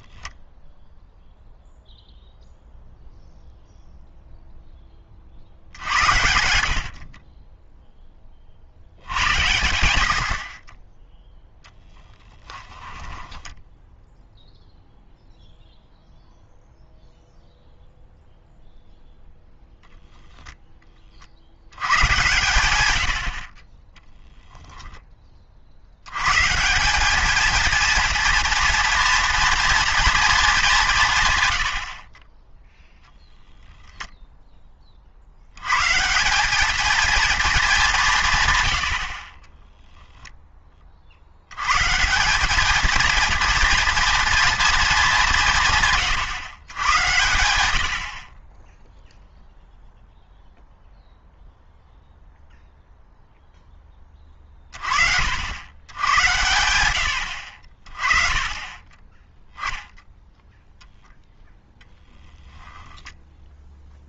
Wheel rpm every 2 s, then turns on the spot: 0, 0, 0, 70, 60, 30, 10, 0, 0, 0, 10, 120, 10, 160, 230, 210, 0, 20, 200, 110, 20, 210, 230, 130, 20, 0, 0, 40, 100, 20, 0, 0.
12-14